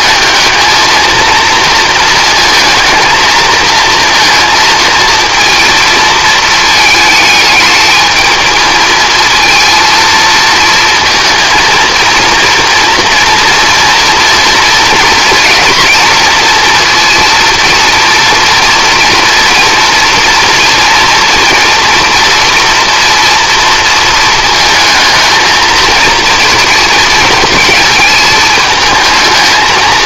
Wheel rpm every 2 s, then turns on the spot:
220, 230, 230, 220, 220, 230, 230, 240, 230, 230, 230, 230, 220, 220, 220.
none